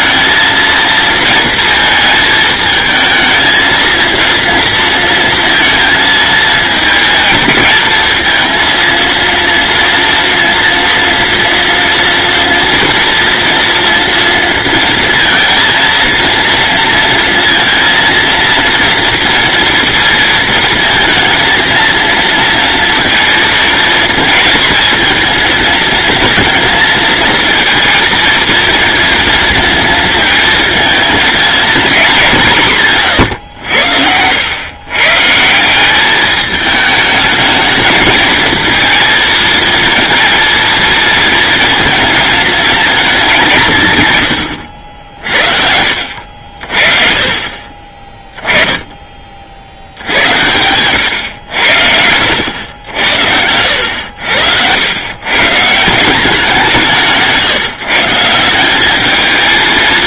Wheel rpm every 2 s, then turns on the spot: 230, 220, 230, 220, 230, 240, 230, 230, 230, 230, 230, 230, 230, 230, 230, 220, 160, 120, 210, 230, 230, 220, 70, 50, 10, 100, 80, 100, 170, 190.
46-48